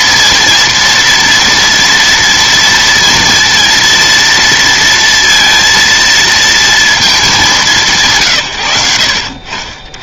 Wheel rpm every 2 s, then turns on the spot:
230, 230, 230, 230, 140.
none